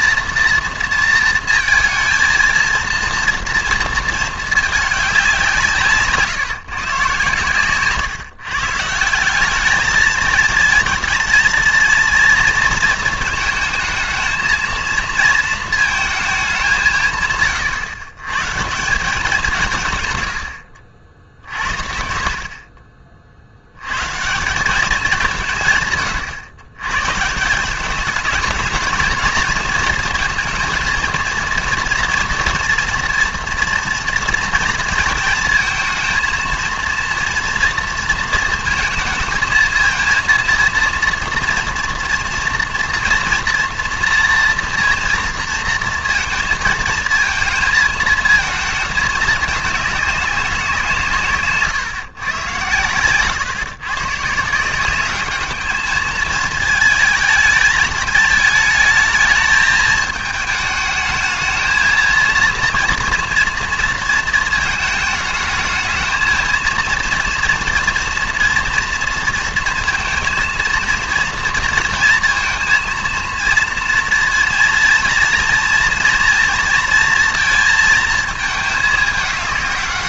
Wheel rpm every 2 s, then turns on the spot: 230, 230, 210, 150, 140, 220, 230, 220, 190, 140, 100, 50, 180, 120, 220, 230, 230, 230, 230, 230, 230, 230, 230, 230, 220, 180, 110, 160, 220, 220, 220, 240, 230, 230, 230, 230, 230, 230, 230, 220.
none